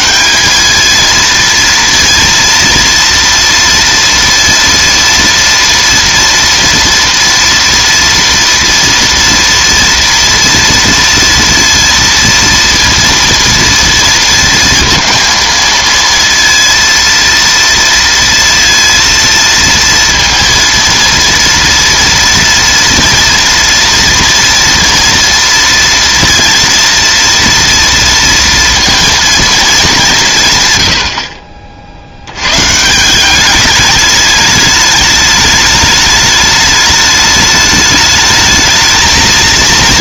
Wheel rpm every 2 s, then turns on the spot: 200, 230, 230, 230, 230, 230, 230, 230, 230, 230, 230, 230, 230, 230, 230, 140, 130, 210, 210, 220.
none